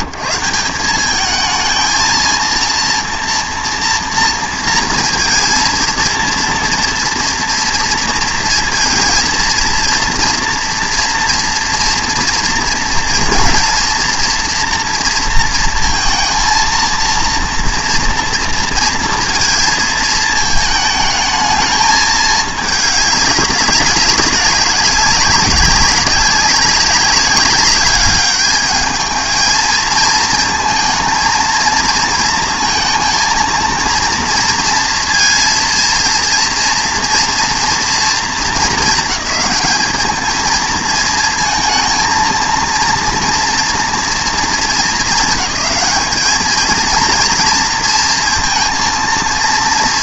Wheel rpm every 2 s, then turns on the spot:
150, 230, 230, 230, 230, 230, 230, 230, 230, 230, 220, 210, 200, 200, 210, 230, 230, 230, 230, 220, 220, 230, 220, 220, 230.
none